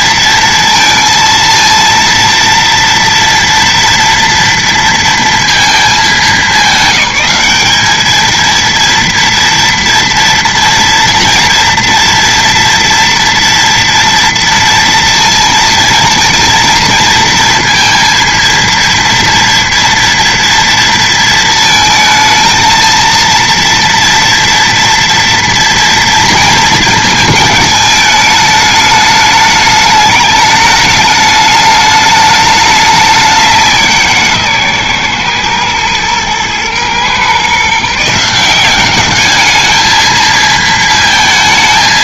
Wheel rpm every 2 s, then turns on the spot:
230, 230, 230, 200, 230, 230, 230, 230, 230, 230, 230, 230, 230, 230, 210, 210, 210, 140, 120, 180, 220.
none